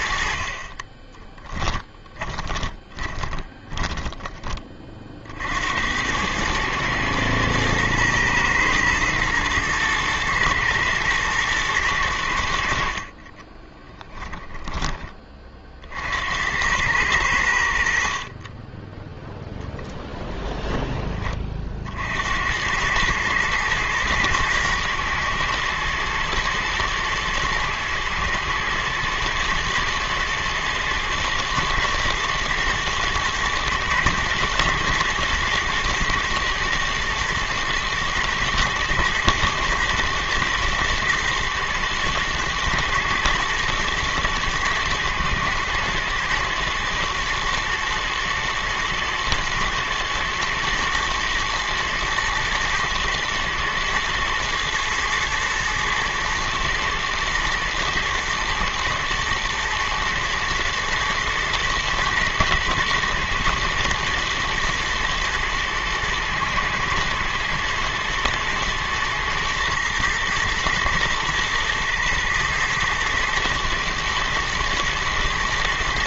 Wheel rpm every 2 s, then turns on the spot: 60, 20, 30, 100, 120, 120, 80, 10, 90, 30, 20, 100, 110, 110, 110, 120, 110, 120, 120, 110, 110, 110, 110, 120, 110, 110, 110, 110, 110, 110, 110, 120, 120, 120, 120, 120, 110, 120.
2-6 14-16